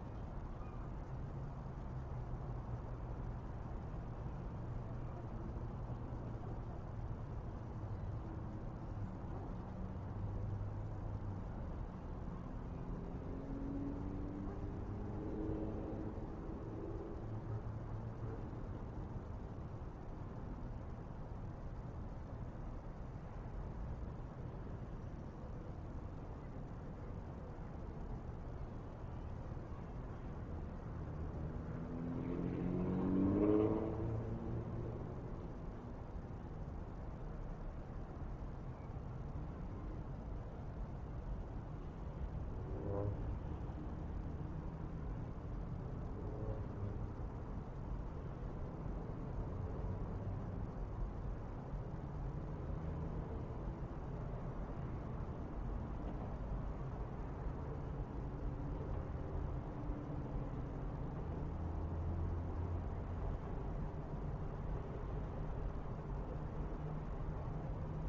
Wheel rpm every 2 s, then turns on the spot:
0, 0, 0, 0, 0, 0, 0, 0, 0, 0, 0, 0, 0, 0, 0, 0, 0, 0, 0, 0, 0, 0, 0, 0, 0, 0, 0, 0, 0, 0, 0, 0, 0, 0.
none